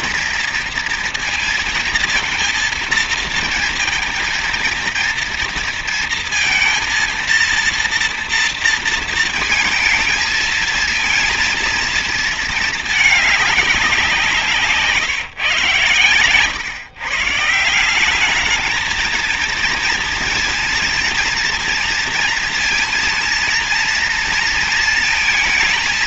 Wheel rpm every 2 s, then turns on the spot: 230, 230, 230, 230, 230, 230, 220, 150, 130, 220, 230, 230, 230.
none